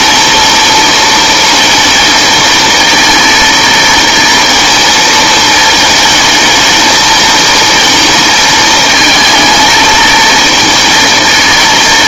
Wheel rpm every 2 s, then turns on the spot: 230, 230, 220, 220, 220, 230.
none